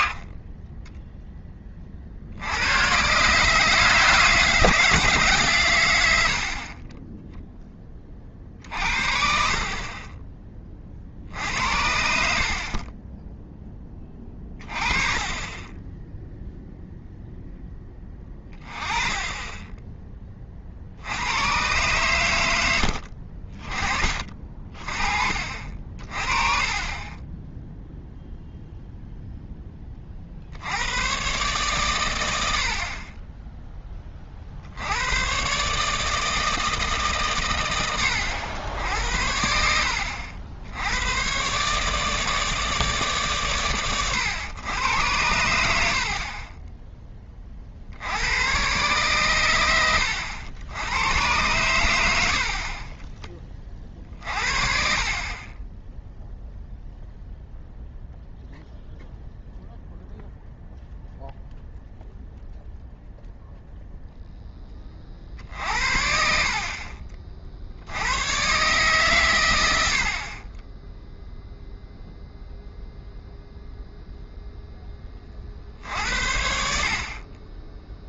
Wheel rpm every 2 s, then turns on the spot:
10, 80, 170, 40, 40, 20, 50, 20, 0, 20, 40, 80, 30, 30, 0, 80, 60, 60, 160, 80, 80, 150, 100, 20, 110, 90, 40, 40, 0, 0, 0, 0, 10, 50, 130, 20, 0, 0, 60.
none